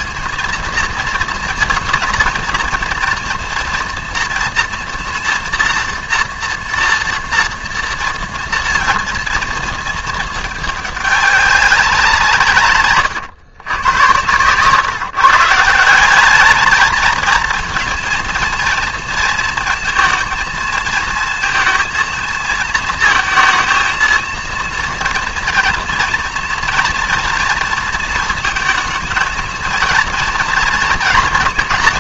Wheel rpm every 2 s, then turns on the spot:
230, 230, 230, 230, 230, 210, 140, 130, 220, 230, 220, 220, 230, 230, 230, 230.
none